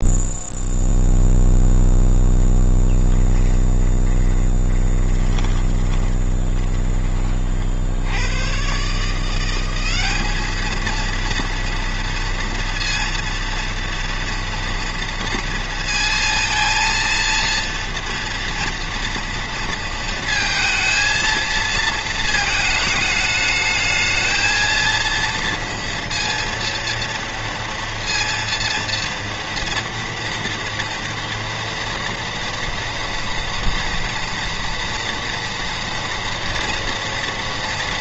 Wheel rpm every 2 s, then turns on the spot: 0, 10, 20, 30, 170, 230, 230, 230, 230, 230, 220, 210, 230, 230, 230, 230, 230, 230, 230.
2-6